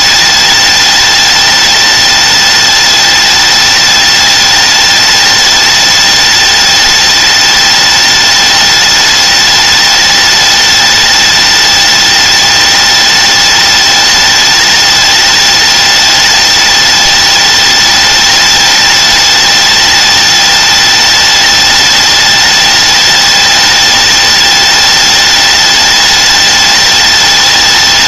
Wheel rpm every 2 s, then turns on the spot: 210, 210, 210, 210, 210, 210, 210, 210, 210, 210, 210, 210, 210, 210.
none